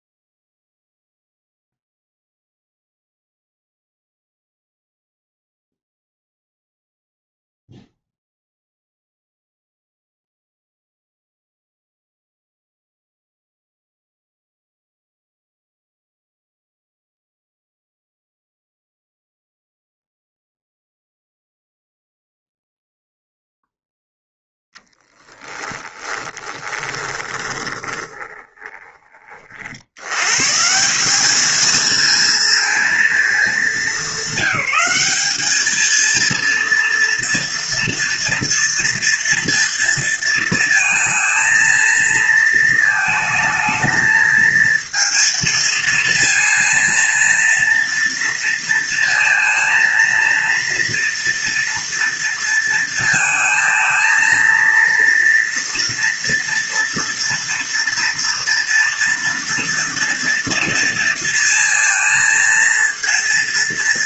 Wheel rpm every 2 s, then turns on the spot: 0, 0, 0, 0, 0, 0, 0, 0, 0, 0, 0, 0, 20, 20, 20, 160, 220, 200, 230, 230, 230, 220, 230, 230, 230, 230, 230, 230, 230, 230, 230, 230.
24-30